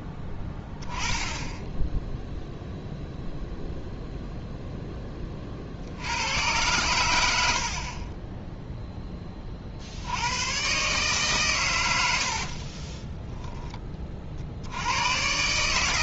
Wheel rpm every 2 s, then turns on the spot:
10, 0, 0, 110, 0, 130, 40, 80.
12-14